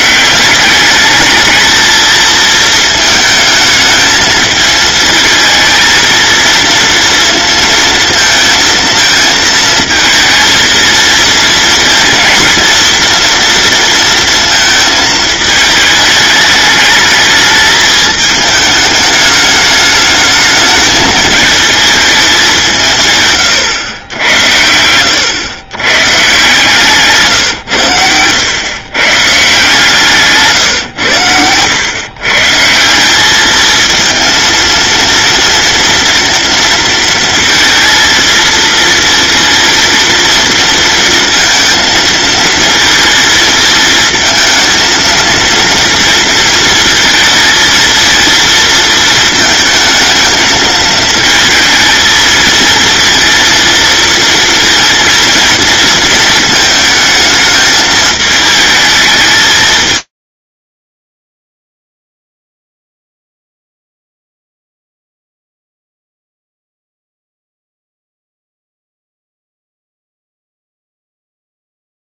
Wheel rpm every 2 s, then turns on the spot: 200, 220, 220, 230, 220, 220, 230, 220, 220, 210, 210, 160, 90, 150, 130, 120, 170, 230, 230, 230, 230, 220, 230, 230, 230, 220, 230, 230, 220, 220, 40, 0, 0, 0, 0, 0.
none